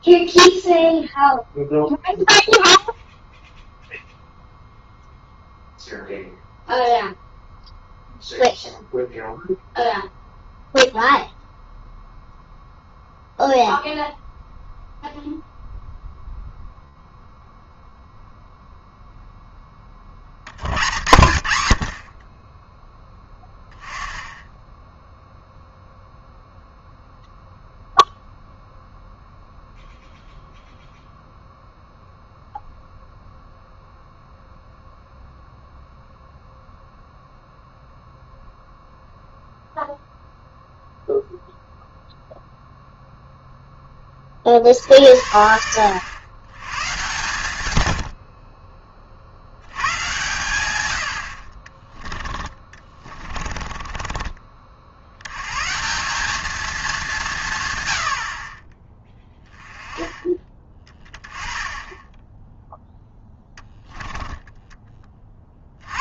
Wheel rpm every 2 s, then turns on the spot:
0, 0, 0, 0, 0, 0, 0, 0, 0, 0, 100, 10, 10, 0, 0, 0, 0, 0, 0, 0, 0, 0, 50, 120, 40, 110, 30, 50, 210, 30, 20, 10, 20.
52-54